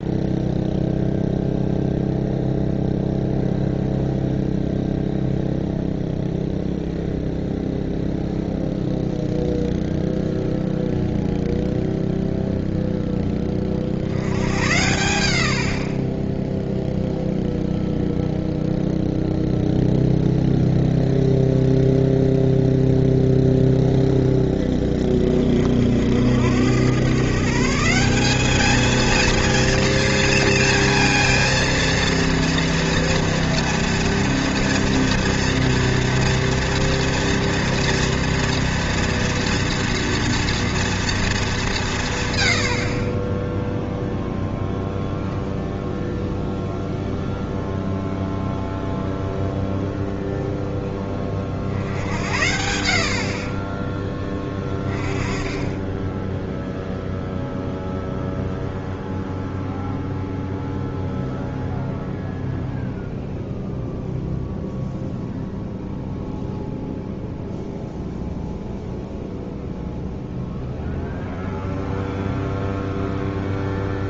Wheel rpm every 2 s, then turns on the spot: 0, 0, 0, 0, 0, 0, 0, 90, 0, 0, 0, 0, 10, 100, 210, 230, 230, 230, 230, 230, 230, 90, 0, 0, 0, 0, 70, 20, 0, 0, 0, 0, 0, 0, 0, 0, 0.
none